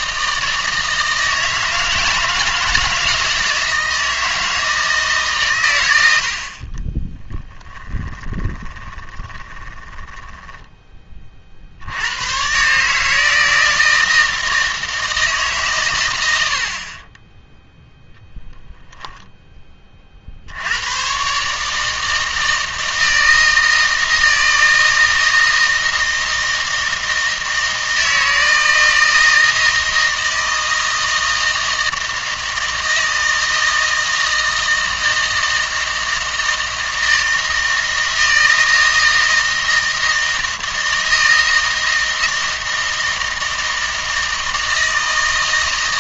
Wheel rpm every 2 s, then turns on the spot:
160, 160, 160, 40, 20, 10, 130, 160, 70, 10, 90, 160, 160, 160, 160, 160, 160, 160, 160, 160, 160, 160, 160.
8-12